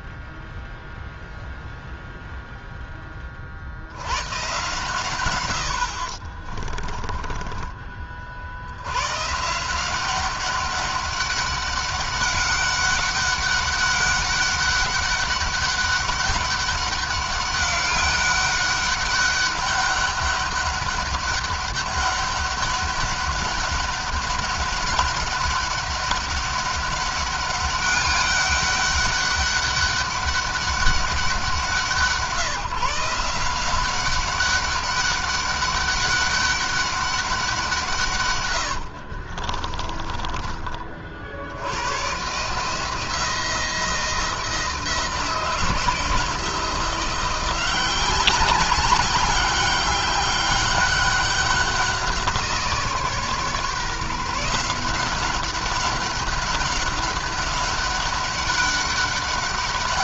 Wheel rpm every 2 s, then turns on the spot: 0, 10, 130, 40, 60, 200, 200, 200, 200, 200, 200, 200, 200, 200, 200, 200, 160, 200, 200, 100, 30, 150, 170, 170, 190, 200, 170, 170, 200, 200.
6-8 38-40